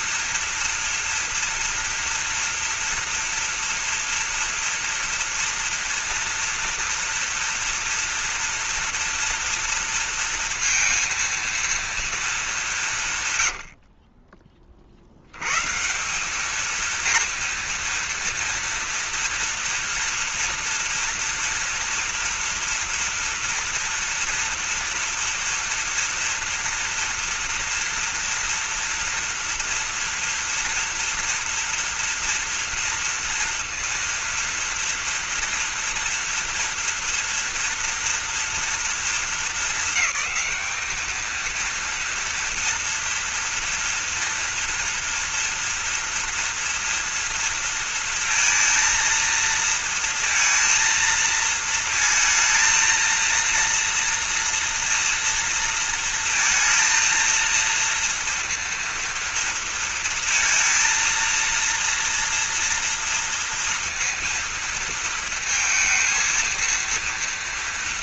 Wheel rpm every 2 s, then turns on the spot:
230, 230, 230, 240, 230, 230, 160, 50, 220, 230, 230, 230, 240, 230, 230, 230, 230, 240, 230, 220, 200, 230, 230, 230, 230, 230, 230, 230, 230, 230, 230, 240, 230, 230.
none